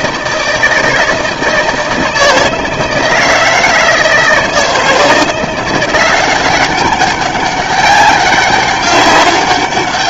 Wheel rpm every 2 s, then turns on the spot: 160, 160, 160, 190, 200.
none